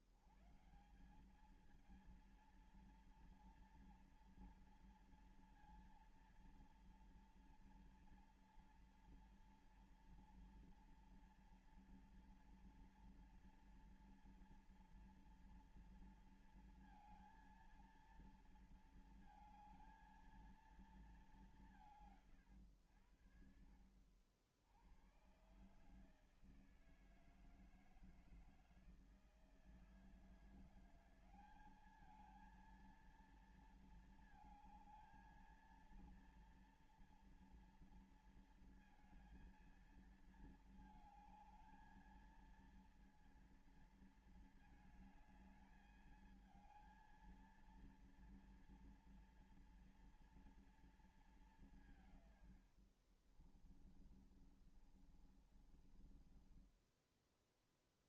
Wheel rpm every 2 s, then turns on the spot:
110, 220, 230, 230, 230, 230, 230, 240, 230, 230, 230, 180, 70, 150, 160, 160, 210, 230, 230, 230, 230, 220, 220, 220, 230, 230, 150, 30, 30.
54-58